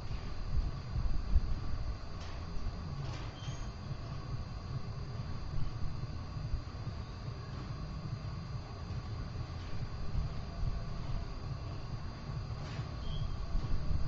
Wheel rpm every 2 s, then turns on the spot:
0, 0, 0, 0, 0, 0, 0.
none